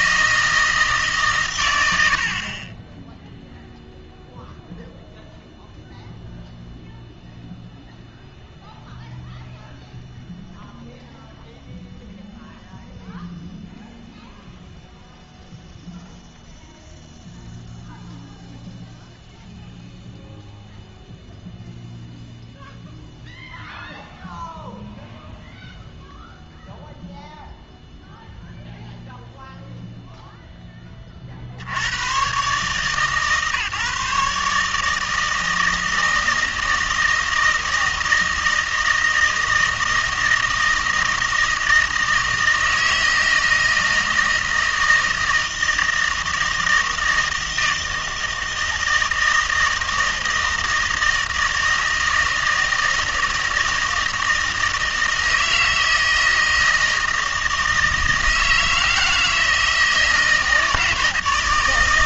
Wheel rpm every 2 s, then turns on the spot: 160, 20, 0, 0, 0, 0, 0, 0, 0, 0, 0, 0, 0, 0, 0, 20, 140, 150, 160, 160, 160, 160, 160, 160, 160, 160, 160, 160, 160, 160, 160.
none